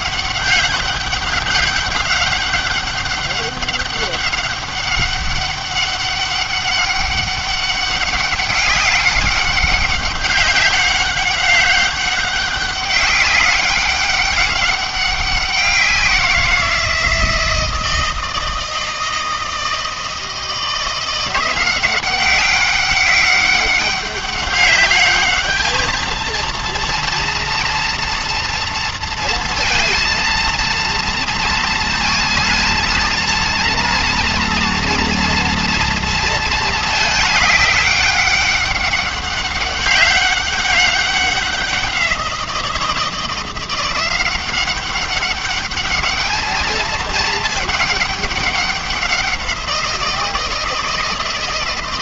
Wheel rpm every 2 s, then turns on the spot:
200, 200, 200, 200, 200, 200, 190, 200, 170, 160, 160, 190, 200, 230, 230, 230, 230, 230, 230, 200, 200, 170, 190, 220, 200, 160.
none